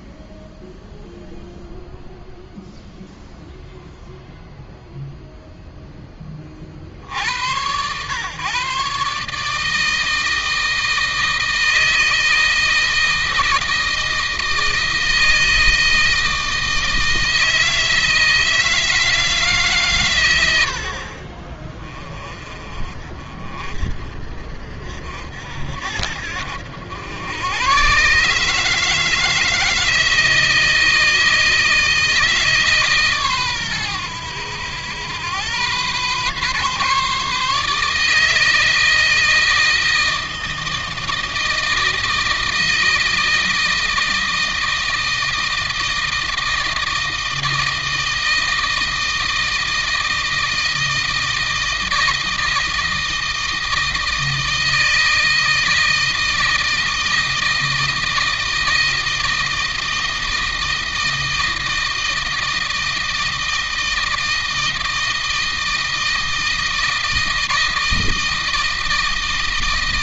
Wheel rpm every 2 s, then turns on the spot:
0, 0, 0, 60, 140, 160, 160, 160, 160, 160, 70, 40, 60, 90, 150, 160, 140, 100, 140, 160, 160, 160, 160, 160, 160, 160, 160, 160, 160, 160, 160, 160, 160, 160, 160.
none